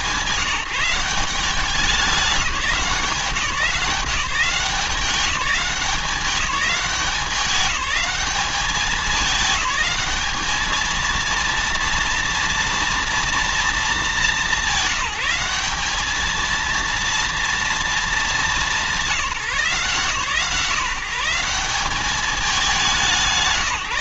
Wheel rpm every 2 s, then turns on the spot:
190, 170, 190, 190, 200, 230, 230, 190, 230, 180, 170, 190.
none